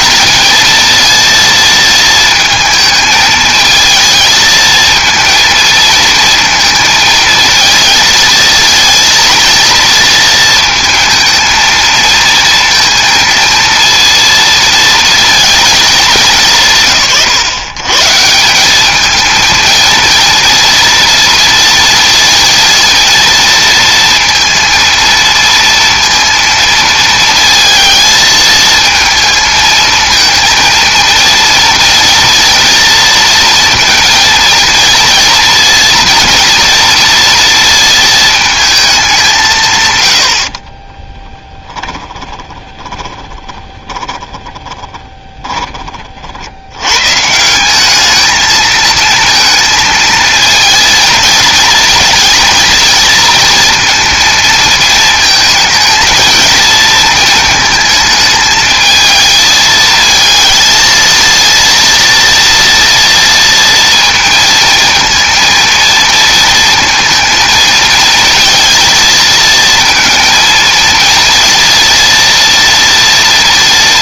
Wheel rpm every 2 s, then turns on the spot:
230, 220, 230, 230, 220, 230, 230, 230, 150, 190, 230, 230, 230, 230, 230, 230, 230, 230, 230, 210, 30, 20, 10, 90, 220, 230, 230, 220, 230, 220, 220, 230, 230, 230, 230, 230, 230.
40-46